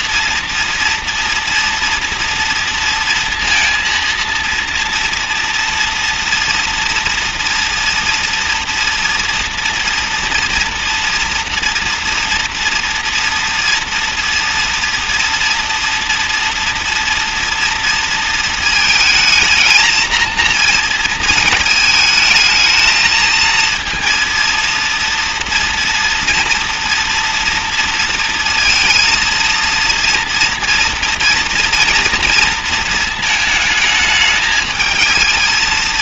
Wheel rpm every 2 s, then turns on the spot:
230, 230, 230, 230, 240, 240, 230, 240, 240, 230, 230, 220, 230, 240, 230, 230, 230, 220.
none